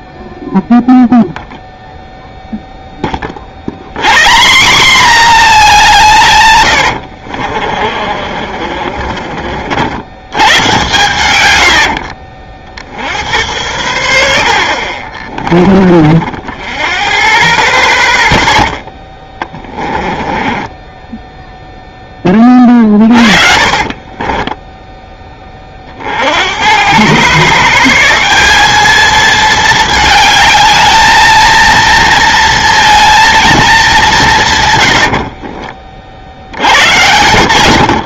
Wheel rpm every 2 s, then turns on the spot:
0, 0, 210, 100, 40, 120, 60, 50, 10, 0, 20, 30, 10, 110, 210, 220, 230, 110, 90.
8-10 16-18 20-24